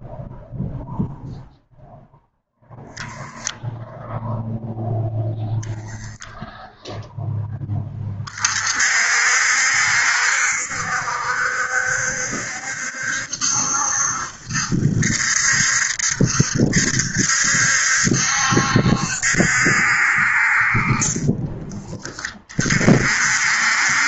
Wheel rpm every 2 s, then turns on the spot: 0, 0, 0, 0, 50, 70, 70, 70, 70, 70, 40, 50.
20-22